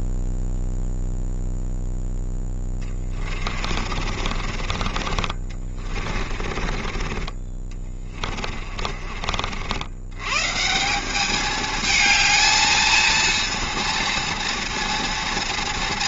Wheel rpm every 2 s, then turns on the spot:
0, 10, 40, 30, 30, 160, 220, 230.
2-10